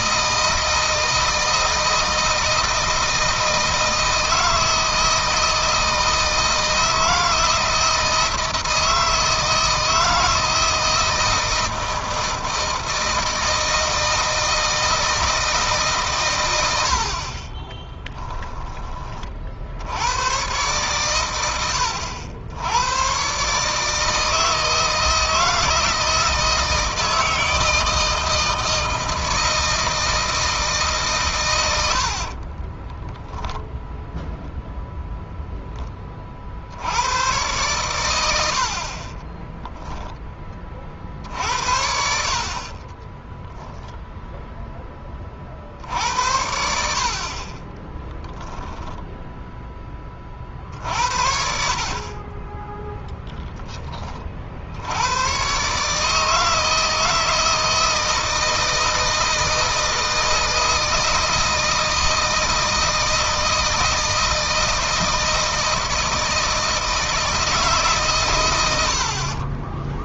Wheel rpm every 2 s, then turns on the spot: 160, 160, 160, 160, 160, 160, 160, 160, 90, 10, 110, 100, 160, 160, 160, 150, 30, 0, 70, 50, 40, 40, 10, 60, 0, 50, 10, 70, 160, 160, 160, 160, 160, 160, 100.
32-34 42-44